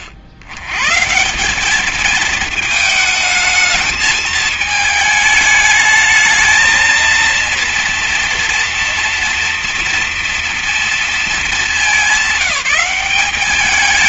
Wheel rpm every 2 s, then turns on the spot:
90, 220, 220, 220, 230, 240, 190.
none